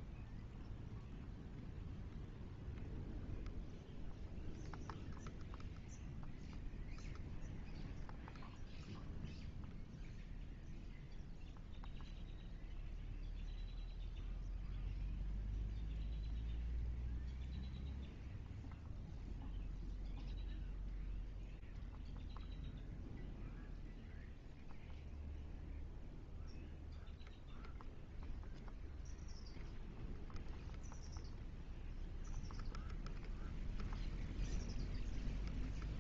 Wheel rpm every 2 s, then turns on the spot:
0, 0, 0, 0, 0, 0, 0, 0, 0, 0, 0, 0, 0, 0, 0, 0, 0, 0.
none